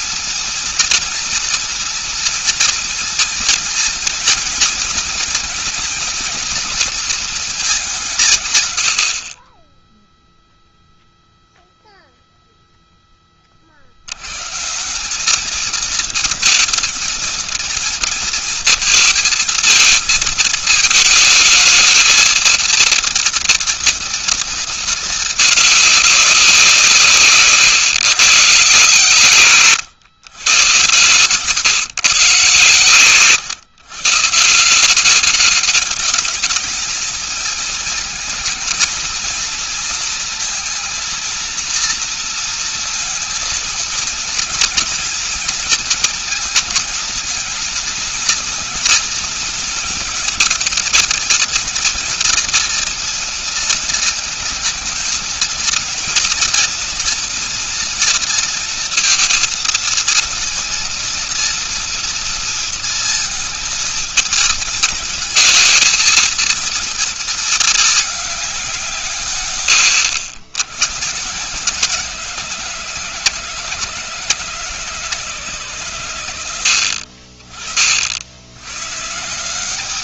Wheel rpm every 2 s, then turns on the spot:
230, 230, 230, 230, 160, 0, 0, 110, 230, 230, 220, 220, 230, 190, 140, 120, 130, 150, 210, 220, 230, 230, 230, 230, 230, 230, 240, 220, 230, 230, 230, 230, 210, 230, 200, 100, 160, 150, 100, 70.
none